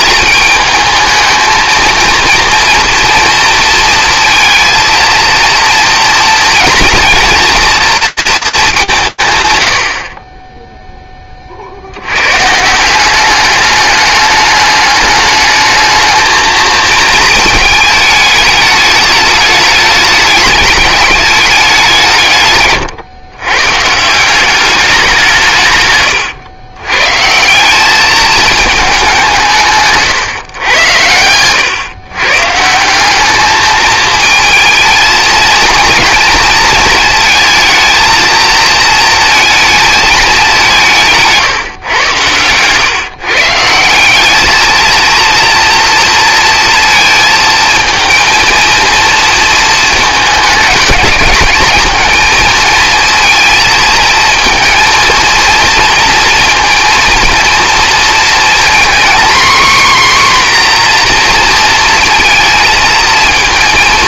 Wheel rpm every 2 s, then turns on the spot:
220, 230, 230, 240, 210, 10, 140, 210, 220, 210, 210, 140, 190, 120, 210, 120, 150, 220, 230, 220, 190, 130, 220, 230, 230, 210, 230, 230, 240, 240, 260, 230.
none